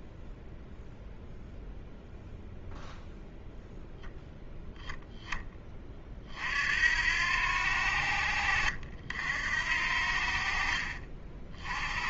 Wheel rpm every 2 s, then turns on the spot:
0, 0, 0, 80, 70, 40.
none